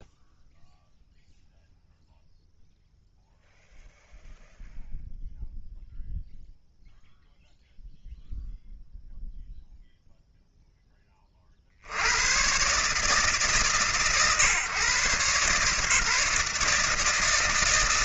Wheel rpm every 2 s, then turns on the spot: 0, 0, 0, 0, 0, 10, 130, 130, 160.
none